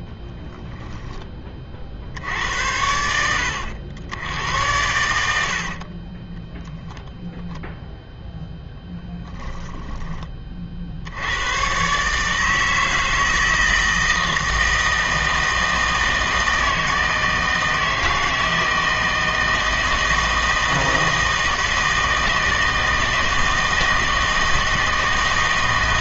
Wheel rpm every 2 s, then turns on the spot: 10, 80, 90, 0, 0, 50, 160, 160, 160, 160, 160, 160, 160.
0-2 4-6